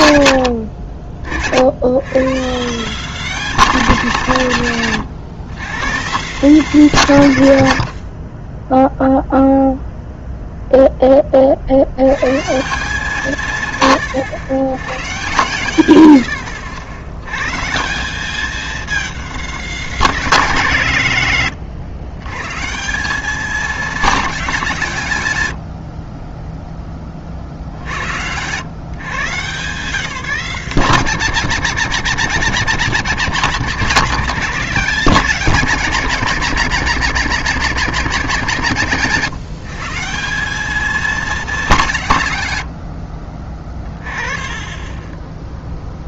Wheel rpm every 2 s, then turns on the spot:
80, 170, 150, 170, 10, 0, 150, 110, 90, 220, 170, 150, 180, 10, 120, 190, 210, 210, 200, 170, 200, 100, 30.
44-46